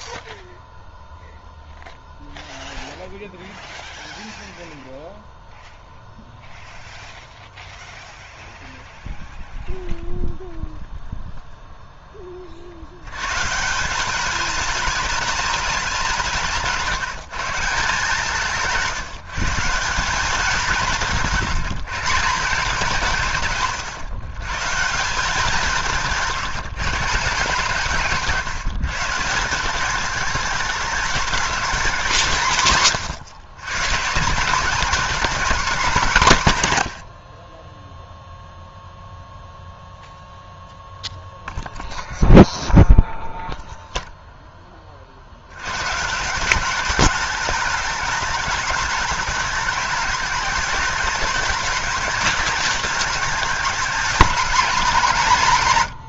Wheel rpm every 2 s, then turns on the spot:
0, 0, 0, 0, 0, 0, 50, 210, 150, 170, 200, 180, 150, 170, 160, 210, 140, 190, 140, 0, 0, 0, 20, 190, 220, 210, 210, 230.
16-18